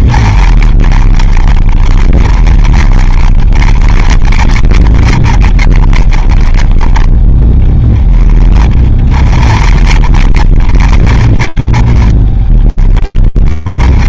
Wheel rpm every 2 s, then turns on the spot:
40, 30, 40, 20, 30, 30, 20.
none